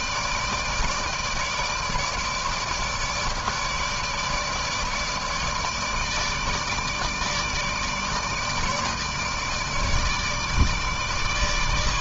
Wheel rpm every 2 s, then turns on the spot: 150, 150, 150, 160, 160, 160.
none